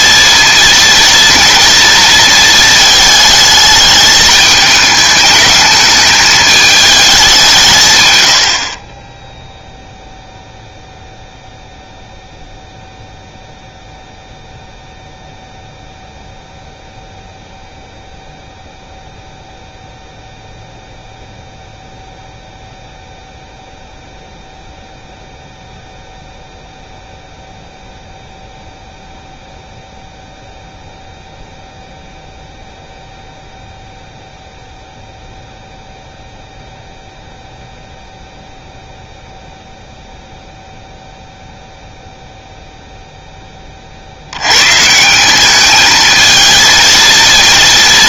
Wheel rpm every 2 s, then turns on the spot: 230, 220, 210, 210, 60, 0, 0, 0, 0, 0, 0, 0, 0, 0, 0, 0, 0, 0, 0, 0, 0, 0, 130, 230.
none